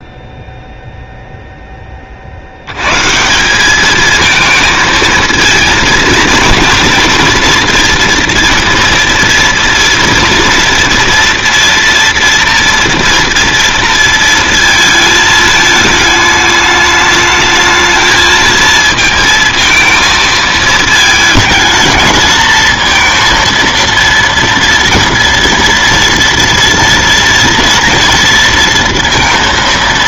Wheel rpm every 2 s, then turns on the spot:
0, 80, 220, 230, 230, 230, 230, 230, 210, 220, 220, 220, 230, 230, 230.
none